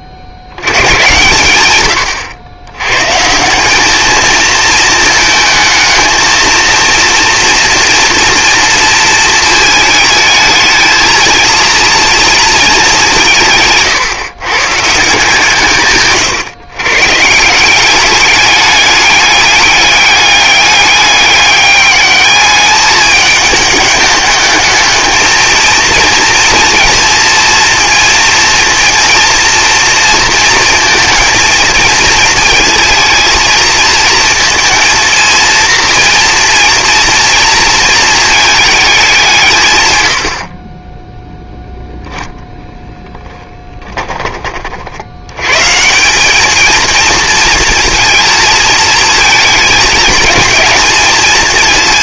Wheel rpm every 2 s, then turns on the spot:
90, 100, 220, 230, 230, 220, 210, 150, 130, 210, 200, 210, 210, 230, 230, 230, 220, 230, 240, 220, 40, 0, 40, 220, 230, 220.
none